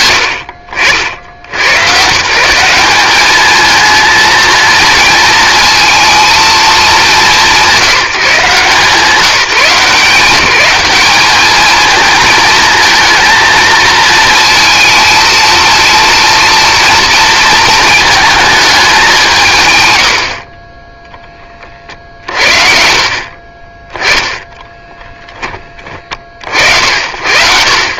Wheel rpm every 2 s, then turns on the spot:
60, 200, 230, 200, 150, 190, 220, 230, 230, 200, 20, 50, 10, 60.
none